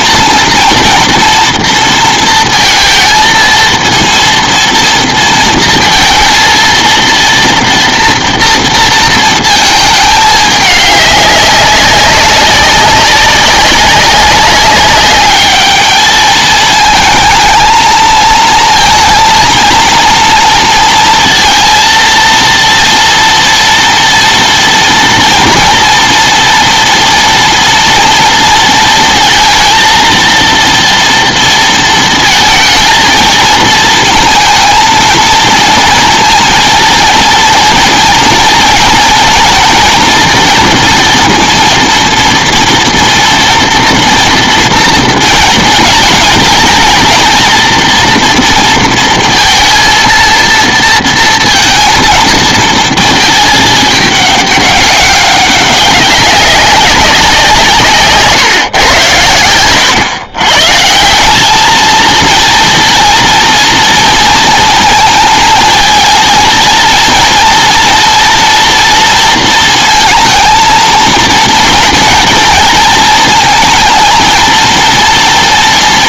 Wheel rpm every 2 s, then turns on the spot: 240, 230, 230, 230, 230, 210, 200, 190, 220, 230, 230, 230, 230, 240, 230, 230, 220, 220, 230, 240, 230, 230, 230, 220, 230, 230, 230, 200, 200, 130, 130, 230, 230, 230, 230, 230, 230, 230.
none